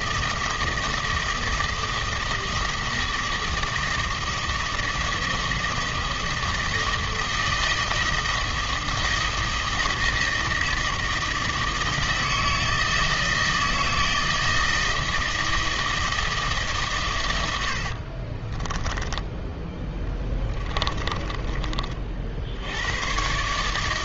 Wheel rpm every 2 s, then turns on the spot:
160, 160, 160, 160, 160, 160, 160, 160, 110, 10, 20, 110.
18-22